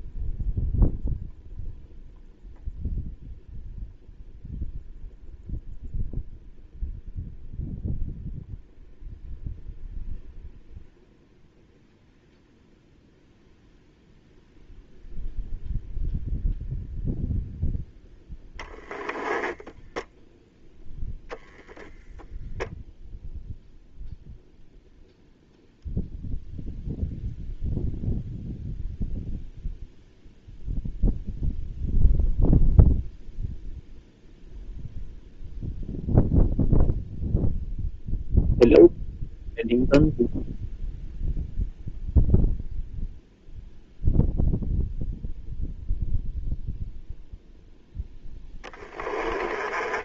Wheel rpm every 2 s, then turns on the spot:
0, 0, 0, 0, 0, 0, 0, 0, 0, 10, 0, 0, 0, 0, 0, 0, 0, 0, 0, 0, 0, 0, 0, 0, 10.
18-20 48-50